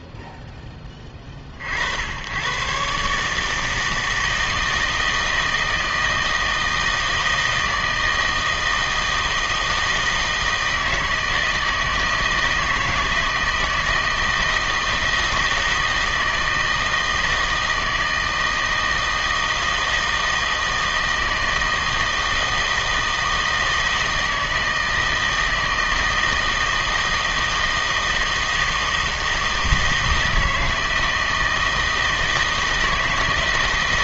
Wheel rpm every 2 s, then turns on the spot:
10, 130, 160, 160, 160, 160, 160, 160, 160, 160, 160, 160, 160, 160, 160, 160, 160.
none